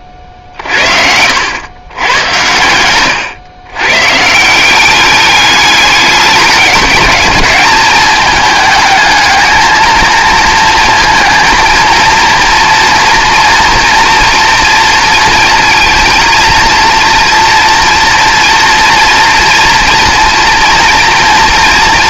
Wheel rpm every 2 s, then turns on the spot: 50, 110, 190, 200, 220, 230, 240, 230, 230, 230, 230.
0-2